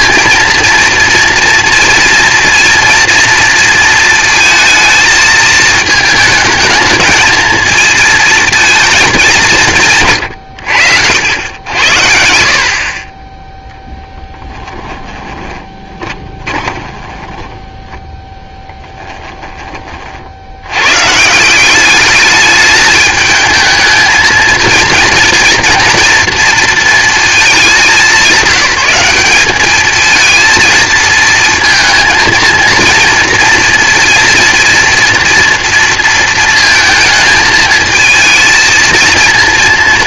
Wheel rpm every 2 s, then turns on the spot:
230, 230, 230, 220, 230, 100, 60, 10, 20, 10, 60, 210, 230, 230, 200, 220, 230, 240, 230, 230.
14-20